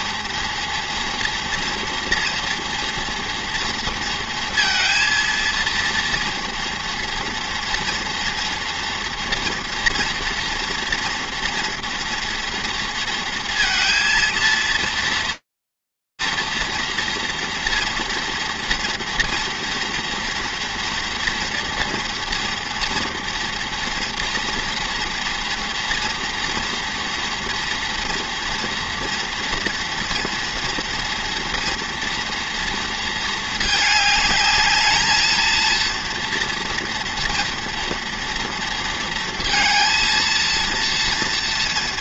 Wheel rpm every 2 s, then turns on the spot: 240, 230, 230, 230, 240, 230, 230, 230, 230, 230, 240, 230, 230, 230, 230, 230, 220, 230, 230, 230, 230.
none